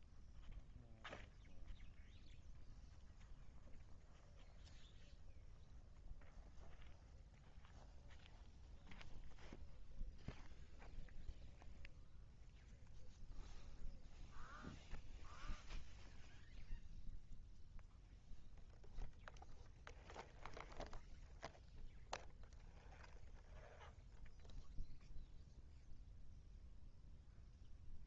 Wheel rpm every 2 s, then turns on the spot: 0, 0, 0, 0, 0, 0, 0, 0, 0, 0, 0, 0, 0, 0.
none